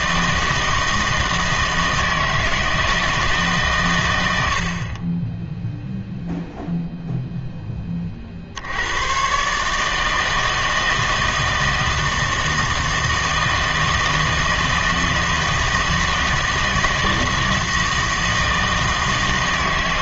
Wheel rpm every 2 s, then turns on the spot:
160, 160, 50, 0, 80, 160, 160, 160, 160, 160.
none